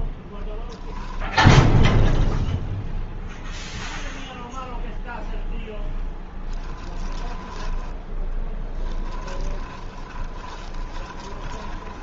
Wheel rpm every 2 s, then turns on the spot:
0, 0, 0, 10, 10, 20.
6-12